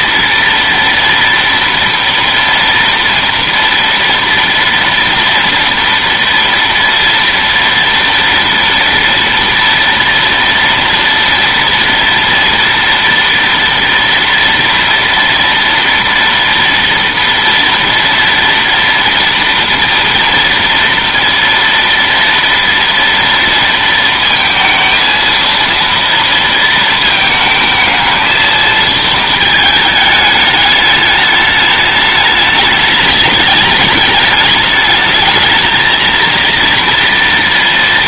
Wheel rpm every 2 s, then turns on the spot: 230, 230, 230, 230, 230, 230, 230, 230, 230, 240, 230, 230, 230, 230, 220, 210, 210, 210, 230.
none